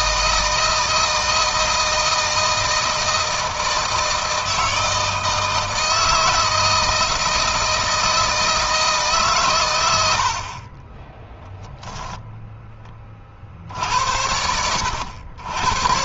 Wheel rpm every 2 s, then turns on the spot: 160, 160, 160, 160, 140, 10, 30, 90.
none